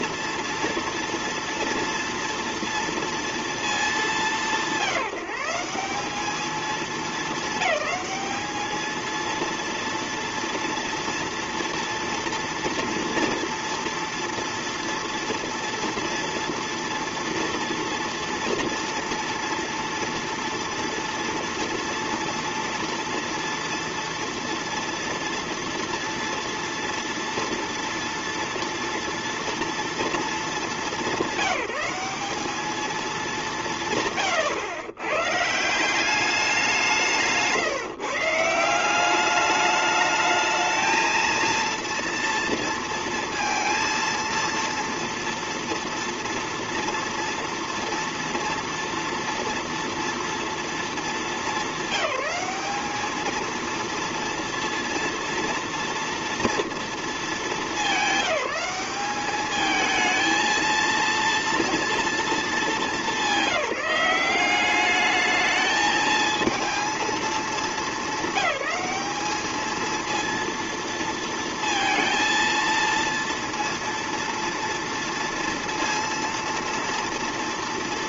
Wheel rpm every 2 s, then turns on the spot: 230, 230, 170, 210, 220, 230, 240, 230, 230, 230, 230, 230, 230, 230, 230, 200, 210, 110, 180, 180, 220, 230, 230, 230, 230, 230, 210, 230, 230, 190, 230, 210, 200, 230, 210, 230, 230, 230, 230.
none